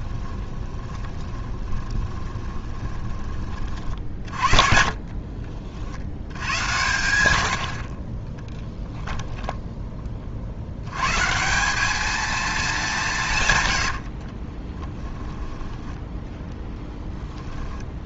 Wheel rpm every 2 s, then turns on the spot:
30, 20, 40, 100, 10, 90, 200, 20, 10.
0-6 8-10 14-18